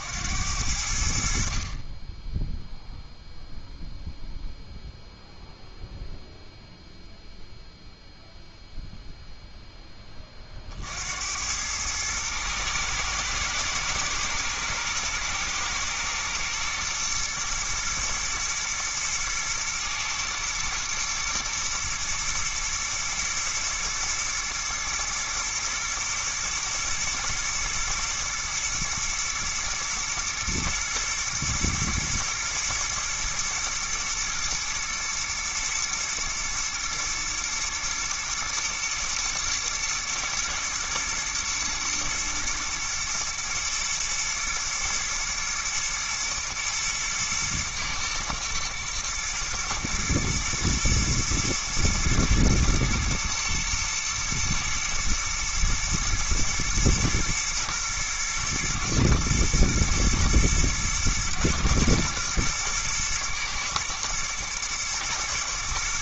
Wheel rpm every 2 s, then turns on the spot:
70, 0, 0, 0, 0, 50, 110, 120, 120, 120, 120, 120, 110, 110, 110, 110, 120, 110, 110, 120, 120, 120, 110, 120, 120, 110, 110, 110, 110, 120, 120, 110, 110.
none